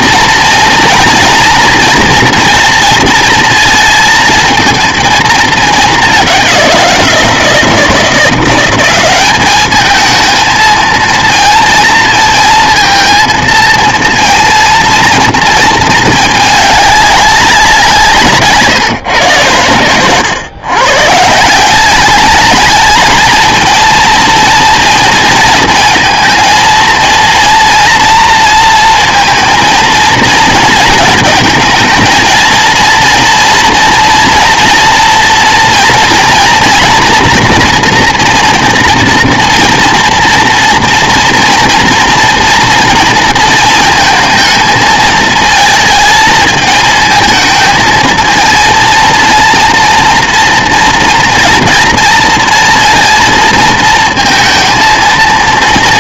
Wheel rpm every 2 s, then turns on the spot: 230, 230, 230, 180, 180, 220, 220, 230, 210, 150, 130, 210, 230, 220, 230, 220, 230, 230, 230, 230, 230, 230, 220, 220, 230, 230, 230, 230.
none